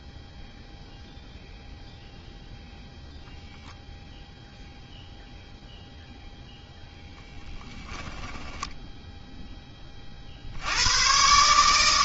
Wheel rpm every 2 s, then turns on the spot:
0, 0, 0, 0, 20, 120.
none